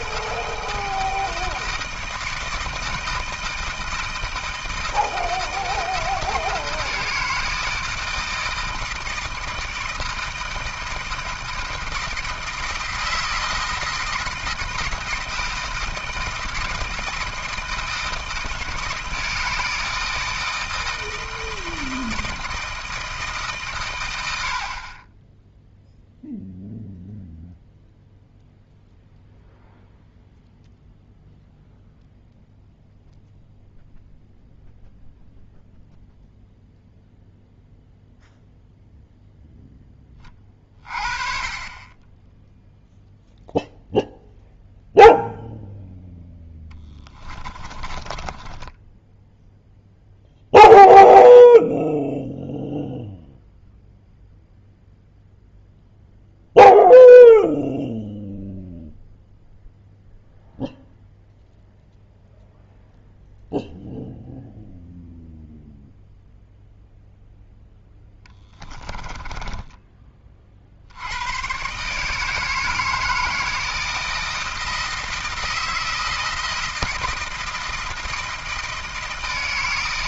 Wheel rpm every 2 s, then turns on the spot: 160, 160, 160, 160, 160, 160, 160, 160, 160, 160, 160, 160, 50, 0, 0, 0, 0, 0, 0, 0, 30, 0, 0, 10, 10, 0, 0, 0, 0, 0, 0, 0, 0, 0, 10, 60, 160, 160, 160, 160.
46-50 68-70